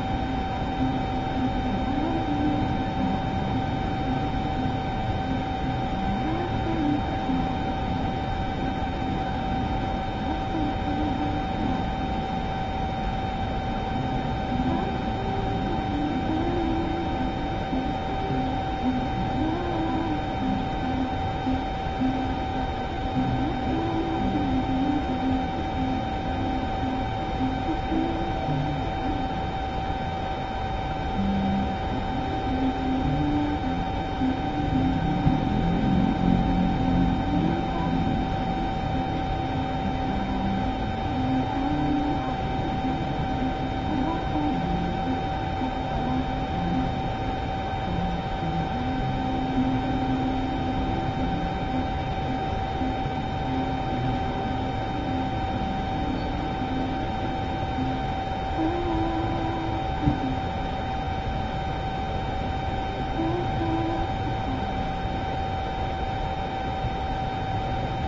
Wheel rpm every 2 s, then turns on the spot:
0, 0, 0, 0, 0, 0, 0, 0, 0, 0, 0, 0, 0, 0, 0, 0, 0, 0, 0, 0, 0, 0, 0, 0, 0, 0, 0, 0, 0, 0, 0, 0, 0, 0.
none